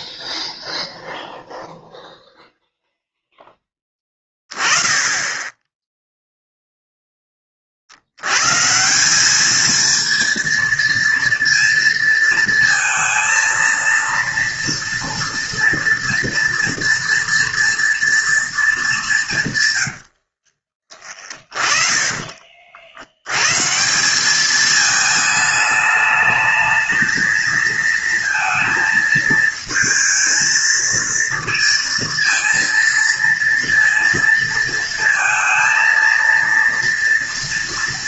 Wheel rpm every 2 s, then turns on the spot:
0, 0, 20, 0, 150, 230, 230, 230, 230, 210, 50, 40, 210, 220, 230, 230, 230, 230, 230.
20-22